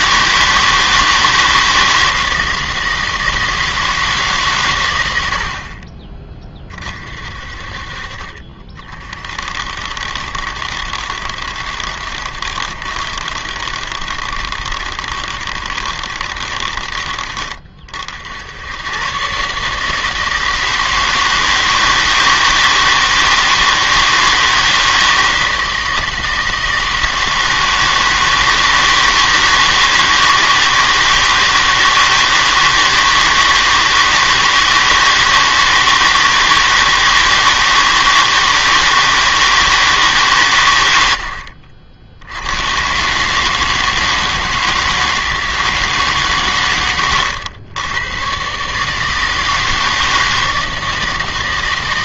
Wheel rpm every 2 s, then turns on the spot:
160, 160, 130, 30, 40, 60, 70, 70, 60, 100, 160, 160, 160, 160, 160, 160, 160, 160, 160, 160, 110, 100, 160, 120, 140, 160.
none